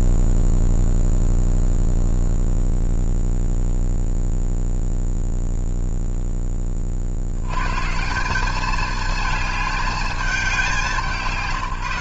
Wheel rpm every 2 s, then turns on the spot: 0, 0, 0, 10, 190, 200.
none